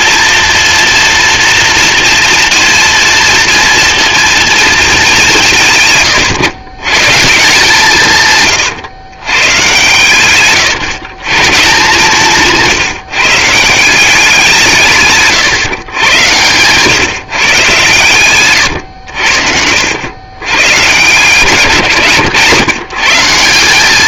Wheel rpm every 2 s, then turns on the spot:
230, 230, 220, 130, 120, 130, 150, 150, 120, 120, 120, 130.
none